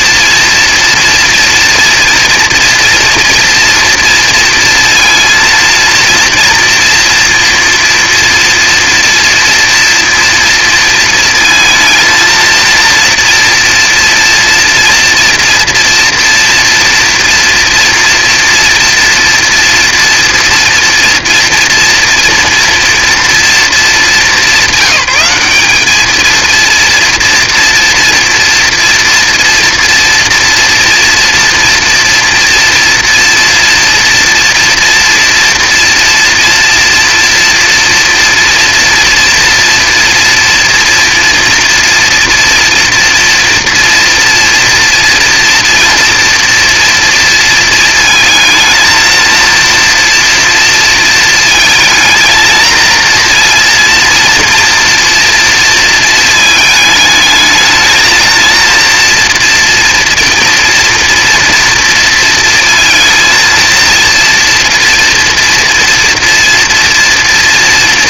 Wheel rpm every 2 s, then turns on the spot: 230, 230, 230, 230, 230, 230, 230, 230, 240, 240, 230, 240, 200, 230, 230, 230, 240, 230, 230, 240, 230, 240, 230, 230, 220, 230, 230, 230, 210, 230, 230, 220, 230, 230.
none